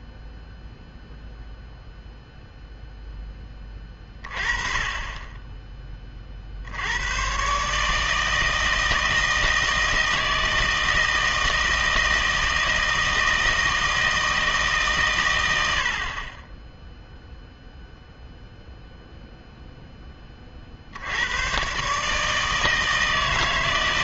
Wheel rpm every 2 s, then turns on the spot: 0, 0, 30, 80, 160, 160, 160, 150, 10, 0, 60, 160.
none